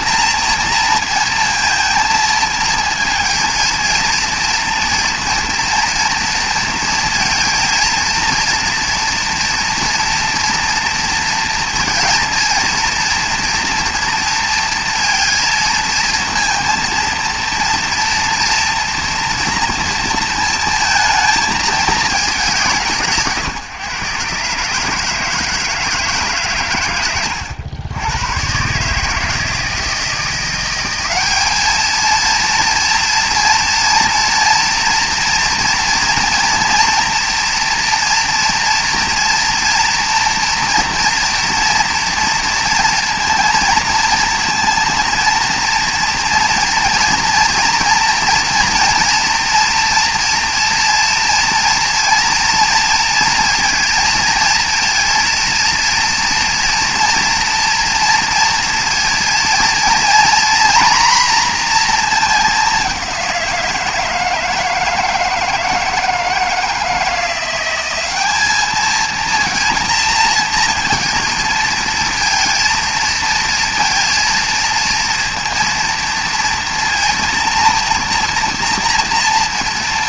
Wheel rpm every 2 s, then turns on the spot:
230, 230, 230, 230, 230, 230, 230, 230, 230, 230, 220, 160, 150, 110, 150, 190, 230, 230, 230, 240, 230, 230, 230, 230, 230, 230, 230, 230, 230, 230, 240, 190, 160, 170, 220, 230, 230, 230, 230, 230.
none